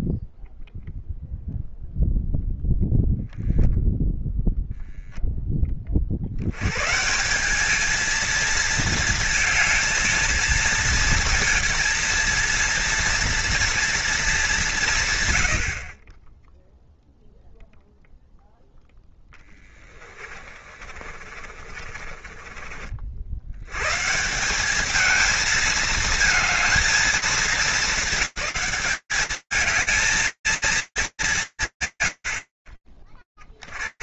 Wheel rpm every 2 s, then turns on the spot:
0, 0, 0, 140, 220, 230, 230, 130, 0, 10, 30, 60, 210, 220, 210, 210, 30.
18-22